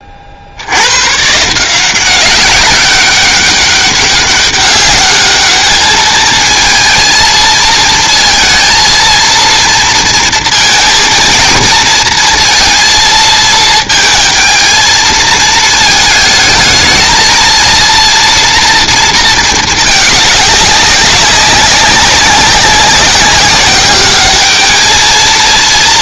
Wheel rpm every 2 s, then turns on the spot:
110, 200, 210, 220, 230, 230, 230, 220, 220, 230, 200, 190, 220.
none